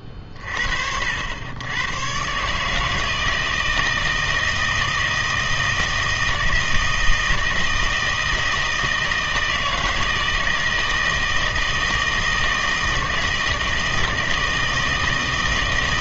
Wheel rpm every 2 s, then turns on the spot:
40, 160, 160, 160, 160, 160, 160, 160.
none